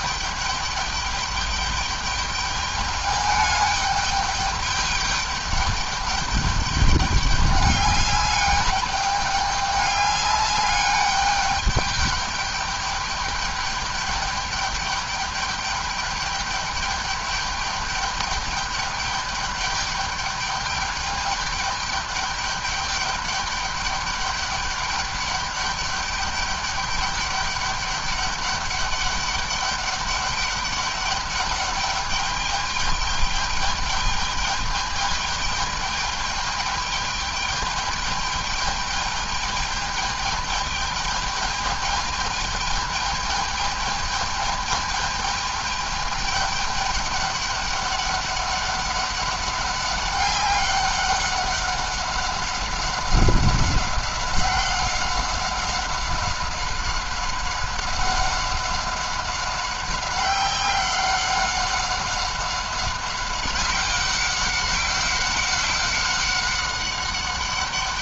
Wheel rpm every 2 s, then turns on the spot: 210, 210, 210, 200, 200, 200, 210, 210, 210, 210, 210, 210, 200, 200, 200, 200, 210, 210, 210, 210, 210, 210, 210, 210, 200, 200, 190, 190, 190, 190, 190, 190, 190, 190.
none